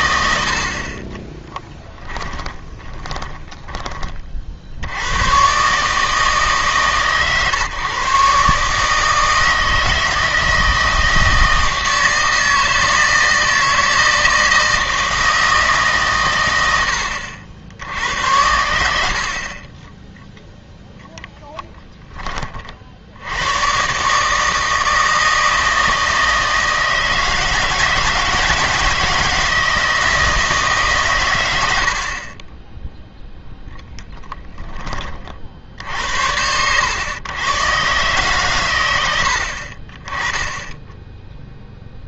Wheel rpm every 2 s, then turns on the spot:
50, 20, 70, 130, 140, 160, 160, 160, 90, 80, 0, 50, 160, 160, 160, 140, 10, 20, 100, 110, 10.
2-4 32-34